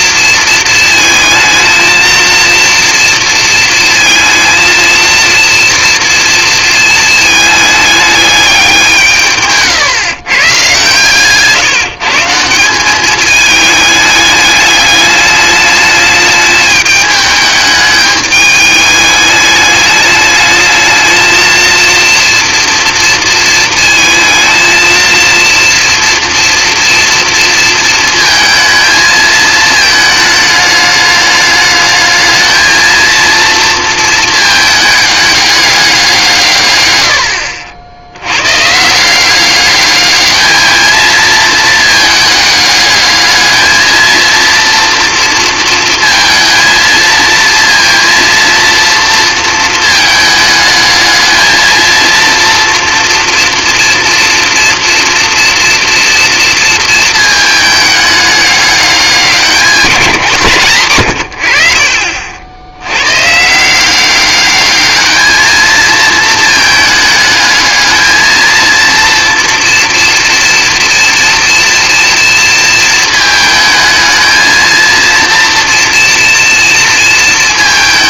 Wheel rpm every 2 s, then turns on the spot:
230, 230, 230, 220, 170, 130, 210, 210, 210, 210, 220, 230, 230, 230, 220, 210, 230, 210, 110, 160, 220, 210, 230, 220, 230, 220, 230, 230, 230, 190, 120, 110, 210, 220, 230, 230, 220, 230, 230.
none